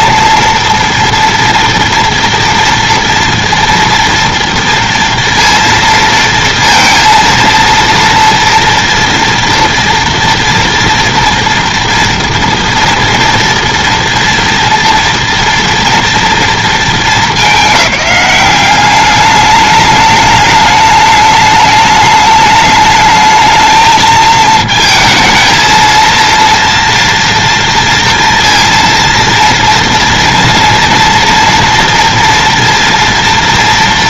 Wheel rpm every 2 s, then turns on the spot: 230, 230, 230, 230, 230, 230, 230, 230, 220, 190, 210, 210, 220, 230, 230, 230, 230.
none